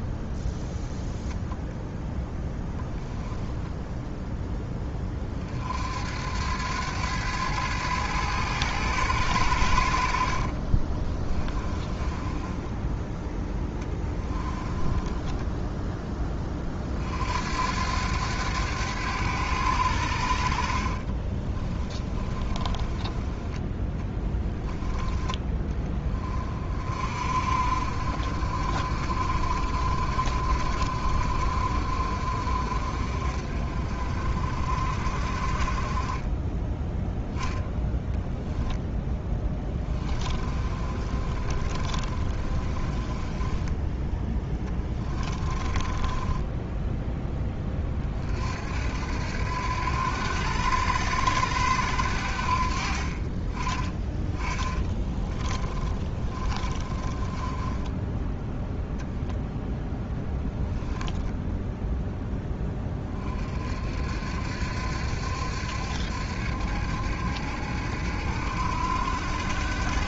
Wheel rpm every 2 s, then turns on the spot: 10, 0, 0, 80, 110, 40, 10, 10, 20, 100, 60, 20, 10, 30, 50, 40, 40, 50, 20, 0, 30, 30, 10, 10, 50, 80, 70, 20, 20, 10, 0, 10, 60, 70, 70.
0-2 10-16 22-24 40-48 54-58